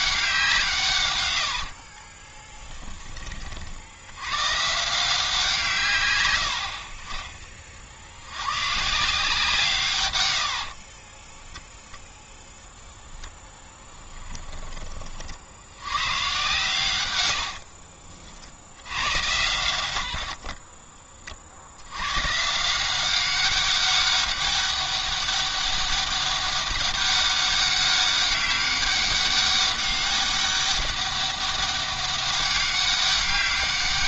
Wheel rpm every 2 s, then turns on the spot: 150, 10, 150, 70, 130, 70, 10, 20, 110, 90, 40, 170, 200, 200, 200, 200, 200.
10-12 20-22